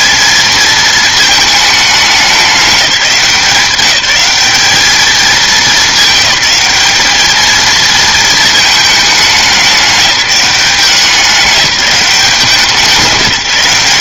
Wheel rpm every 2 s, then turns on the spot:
220, 200, 210, 210, 220, 190, 170.
none